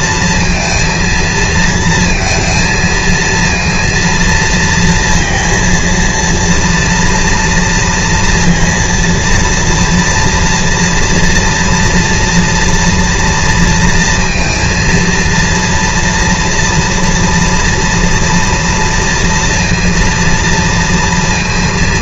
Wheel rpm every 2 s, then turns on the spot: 230, 230, 230, 230, 230, 230, 230, 230, 230, 230, 230.
none